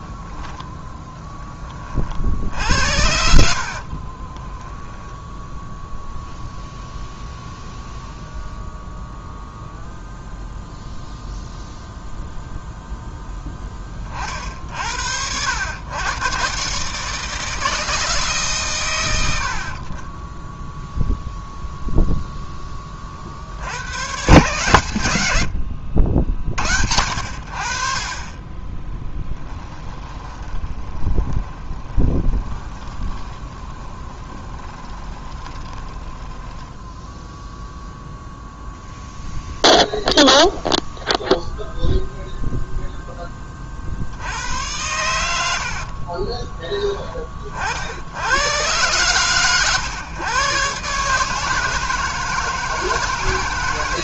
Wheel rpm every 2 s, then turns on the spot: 0, 70, 0, 0, 0, 0, 0, 80, 150, 100, 0, 40, 90, 80, 10, 20, 20, 20, 0, 0, 0, 10, 100, 30, 100, 140, 160.
28-36